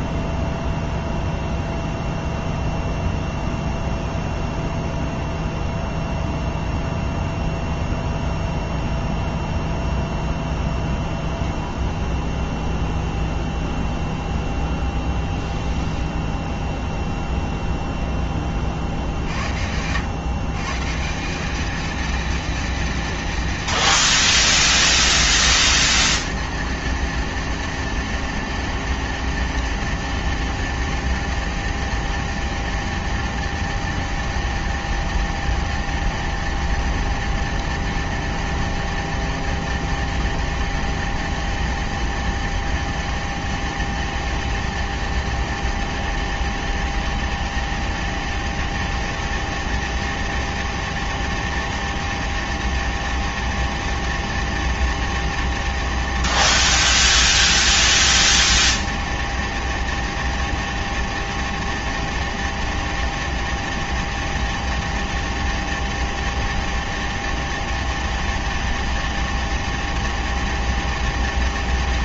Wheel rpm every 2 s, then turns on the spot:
0, 0, 0, 0, 0, 0, 0, 0, 0, 30, 140, 230, 170, 220, 230, 230, 230, 230, 230, 230, 230, 230, 230, 230, 230, 230, 230, 230, 230, 230, 230, 230, 230, 230, 230, 230.
none